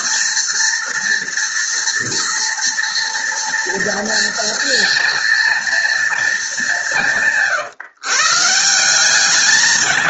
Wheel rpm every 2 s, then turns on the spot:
230, 230, 230, 190, 170.
none